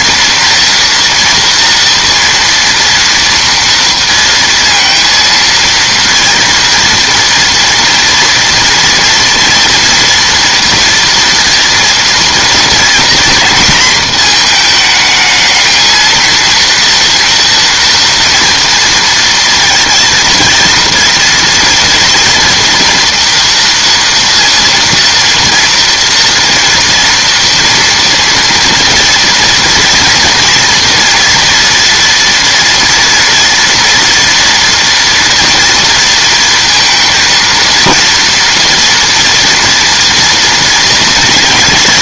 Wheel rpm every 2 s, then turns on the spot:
240, 230, 230, 230, 230, 230, 230, 220, 230, 230, 230, 230, 230, 230, 230, 240, 230, 230, 230, 230, 230.
none